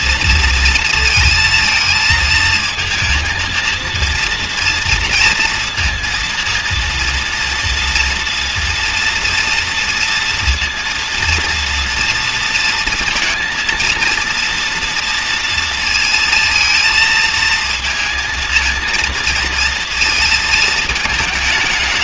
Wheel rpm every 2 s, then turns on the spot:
230, 230, 230, 230, 230, 230, 230, 230, 230, 230, 220.
none